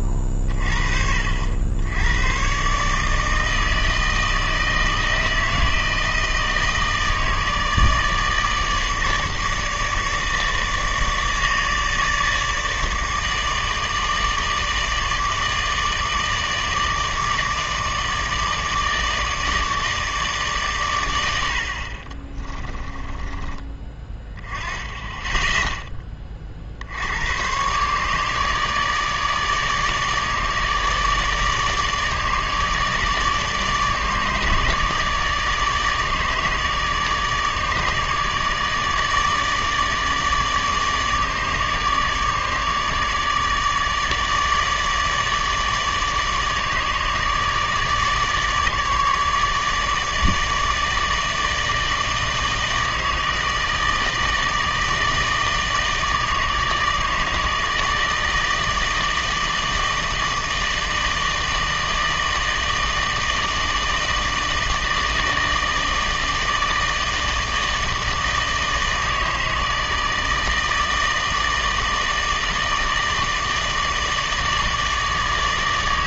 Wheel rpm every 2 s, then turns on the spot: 40, 140, 160, 160, 150, 150, 160, 150, 160, 160, 130, 20, 10, 50, 150, 150, 150, 150, 150, 150, 150, 150, 150, 150, 150, 150, 160, 160, 150, 160, 160, 160, 160, 160, 160, 160, 160, 150.
22-24